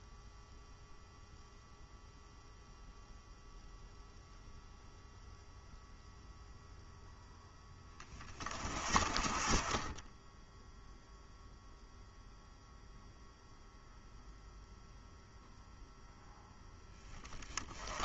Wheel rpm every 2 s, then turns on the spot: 0, 0, 0, 0, 30, 0, 0, 0, 10.
none